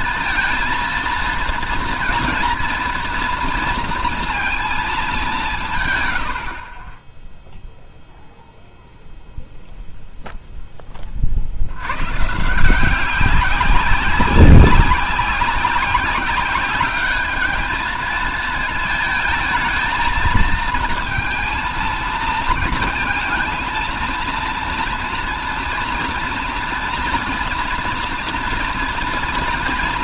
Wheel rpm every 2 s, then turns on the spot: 230, 230, 230, 60, 0, 10, 150, 190, 200, 220, 220, 230, 230, 230, 230.
none